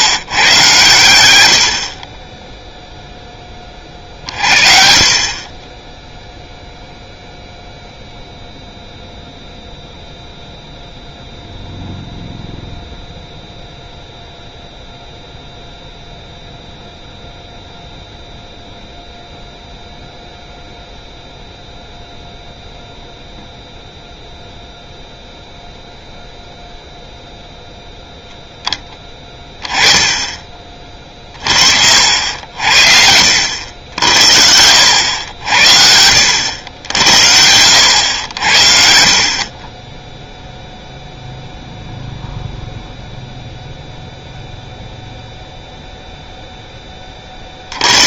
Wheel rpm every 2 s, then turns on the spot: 120, 0, 50, 0, 0, 0, 0, 0, 0, 0, 0, 0, 0, 0, 10, 30, 60, 80, 90, 70, 0, 0, 0, 10.
none